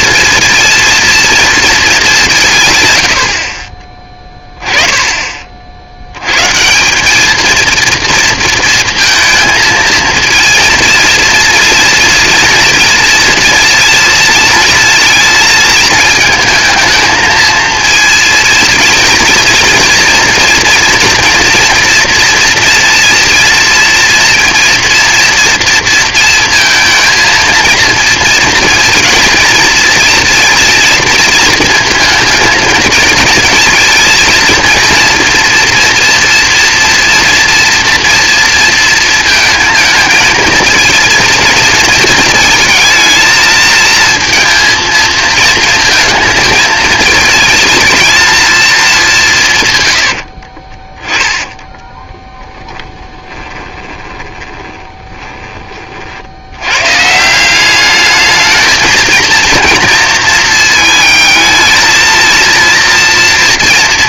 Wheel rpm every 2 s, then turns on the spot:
230, 140, 10, 150, 230, 230, 230, 230, 220, 230, 230, 230, 230, 230, 230, 230, 220, 230, 230, 230, 230, 220, 230, 230, 220, 40, 10, 20, 110, 220, 220, 230.
50-56